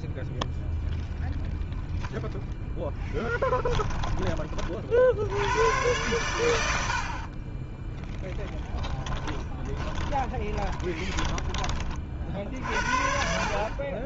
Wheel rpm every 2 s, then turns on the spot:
0, 0, 30, 100, 20, 20, 40.
8-12